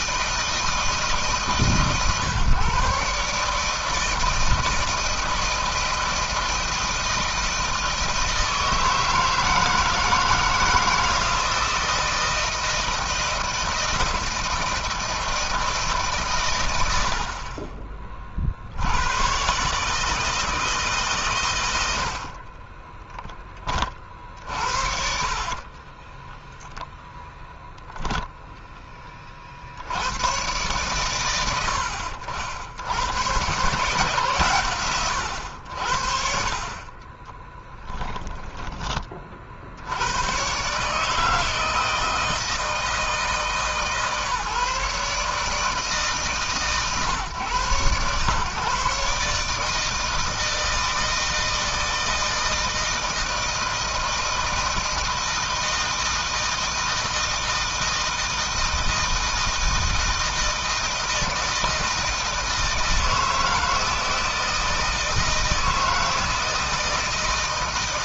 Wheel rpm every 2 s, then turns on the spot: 160, 140, 160, 160, 160, 160, 170, 160, 80, 90, 140, 20, 50, 0, 20, 110, 80, 120, 30, 30, 140, 160, 150, 130, 140, 160, 160, 160, 160, 160, 160, 160, 160, 160.
16-18 22-24 36-38